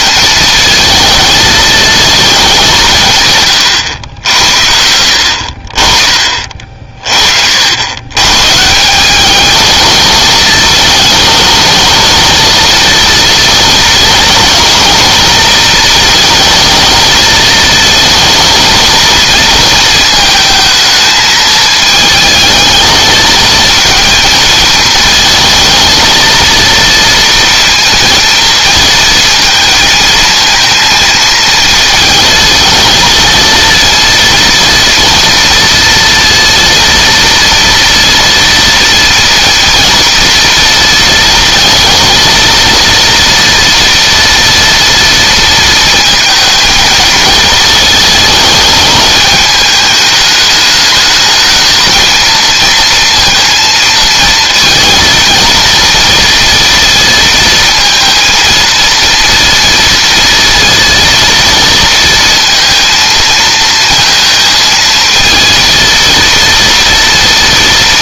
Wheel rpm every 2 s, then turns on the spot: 230, 170, 80, 40, 170, 220, 230, 230, 220, 230, 220, 220, 220, 230, 230, 220, 220, 230, 230, 230, 230, 230, 230, 220, 210, 210, 230, 230, 230, 230, 230, 230, 220, 230.
none